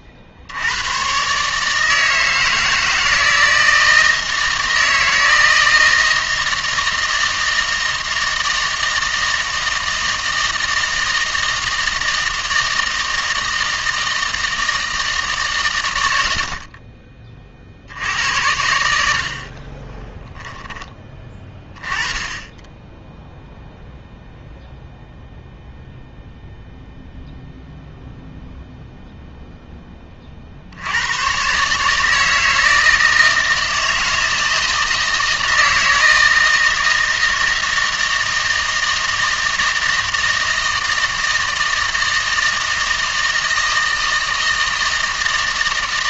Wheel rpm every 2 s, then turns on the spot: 90, 160, 160, 160, 160, 160, 160, 160, 60, 90, 10, 10, 0, 0, 0, 70, 160, 160, 160, 160, 160, 160, 160.
none